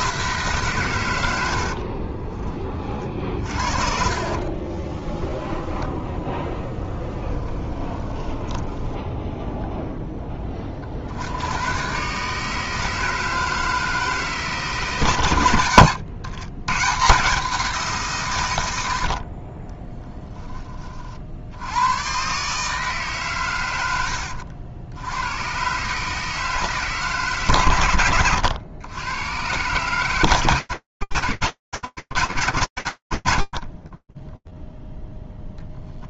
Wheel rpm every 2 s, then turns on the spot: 150, 40, 40, 10, 10, 20, 150, 160, 120, 110, 10, 140, 70, 150, 100, 130, 10, 10.
4-10 32-34